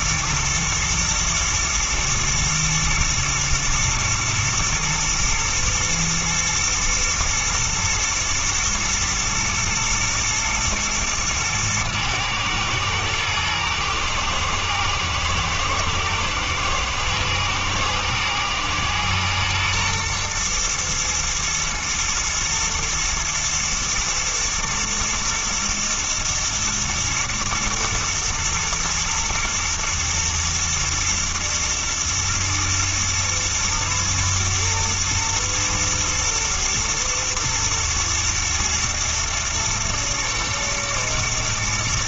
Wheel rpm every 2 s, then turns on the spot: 110, 110, 120, 120, 110, 110, 110, 110, 110, 120, 110, 110, 110, 110, 110, 120, 110, 110, 110, 110, 110.
none